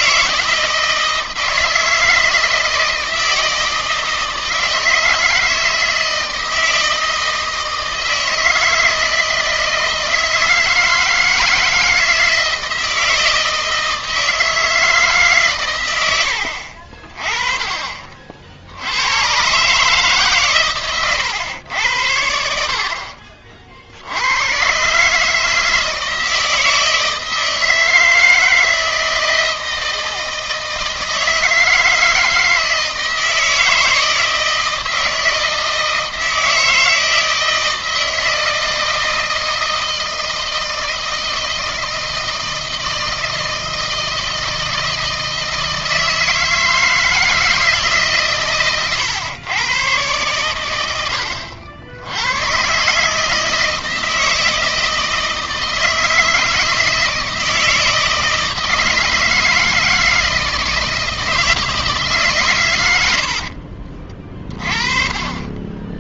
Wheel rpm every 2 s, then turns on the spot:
160, 160, 160, 160, 160, 160, 160, 160, 60, 70, 130, 60, 120, 160, 160, 160, 160, 160, 160, 160, 160, 160, 160, 160, 130, 110, 120, 160, 160, 160, 160, 120, 30.
none